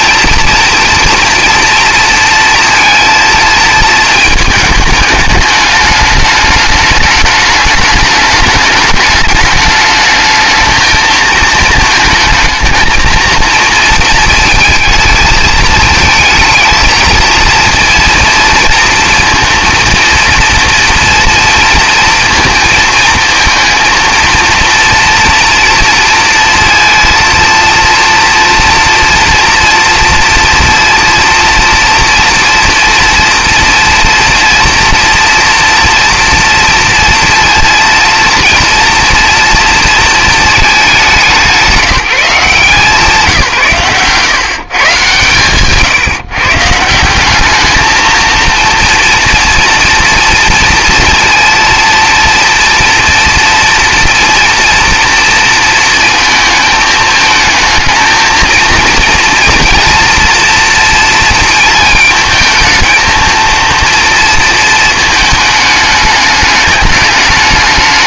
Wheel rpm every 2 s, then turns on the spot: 240, 230, 220, 210, 210, 220, 220, 220, 220, 220, 230, 230, 230, 230, 230, 230, 230, 230, 230, 230, 210, 170, 140, 170, 230, 230, 230, 230, 220, 230, 230, 220, 230, 210.
none